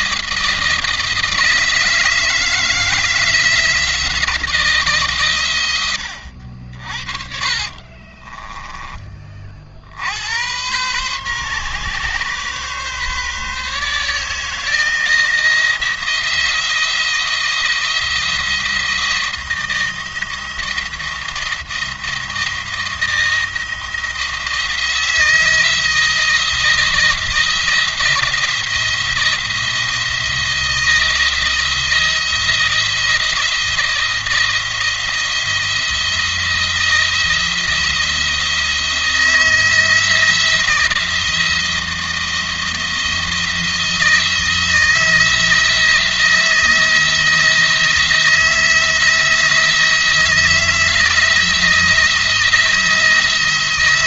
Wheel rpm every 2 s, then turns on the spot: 170, 160, 140, 50, 20, 110, 140, 160, 170, 170, 170, 170, 170, 170, 170, 170, 170, 170, 170, 160, 170, 160, 170, 170, 170, 170, 160.
6-8